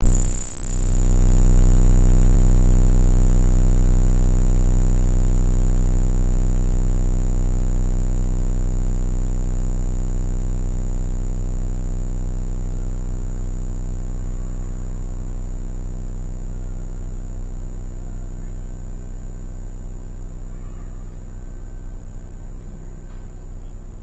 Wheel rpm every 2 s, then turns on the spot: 0, 0, 0, 0, 0, 0, 0, 0, 0, 0, 0, 0.
none